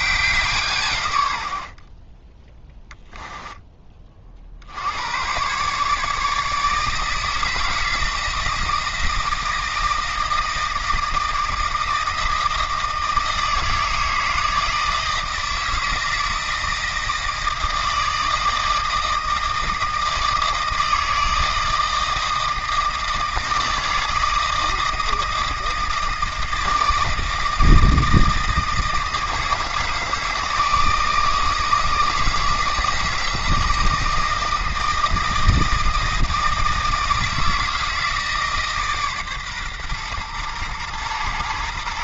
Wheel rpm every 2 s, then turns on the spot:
140, 10, 80, 150, 160, 160, 160, 160, 160, 160, 160, 160, 160, 160, 160, 160, 160, 160, 160, 150, 110.
none